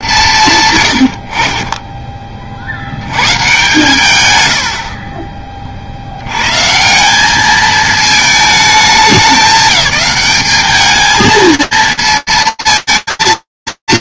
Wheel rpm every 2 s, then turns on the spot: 120, 60, 70, 140, 220, 210, 230.
none